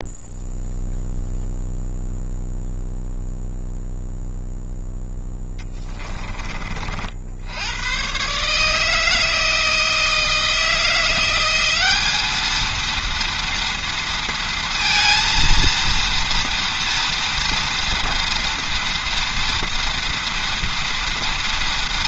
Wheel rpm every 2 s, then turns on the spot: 0, 0, 10, 60, 160, 170, 230, 230, 230, 230, 230.
4-6